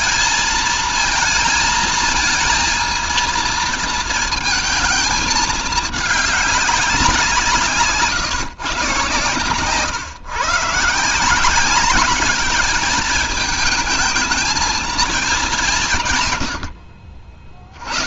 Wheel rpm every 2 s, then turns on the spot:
230, 230, 220, 190, 130, 160, 220, 210, 40.
none